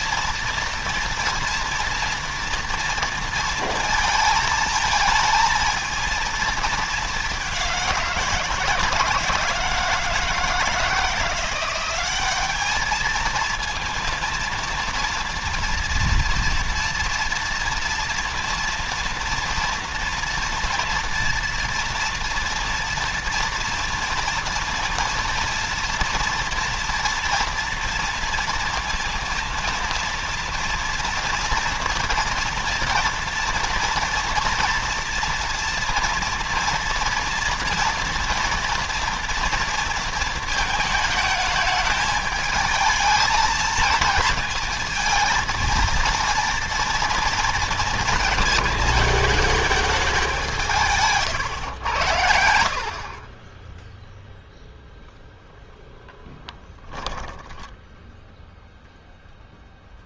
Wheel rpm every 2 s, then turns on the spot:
230, 240, 230, 220, 170, 160, 200, 230, 230, 230, 240, 230, 230, 230, 230, 230, 230, 230, 230, 230, 220, 220, 220, 230, 220, 170, 60, 10, 20, 0.
52-54 56-58